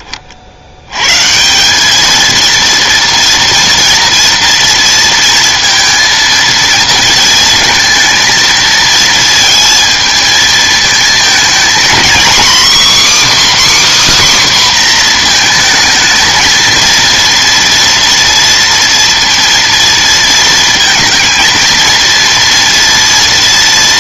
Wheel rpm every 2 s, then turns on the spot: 70, 230, 230, 230, 220, 220, 260, 270, 230, 230, 230, 230.
none